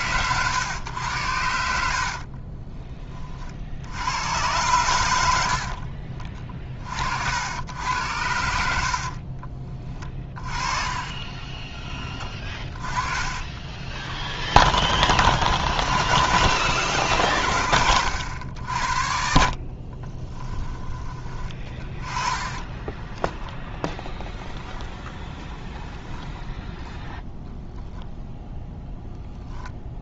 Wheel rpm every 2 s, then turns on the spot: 120, 50, 110, 40, 80, 30, 20, 20, 90, 80, 20, 20, 0, 0, 0.
2-4 10-14 20-24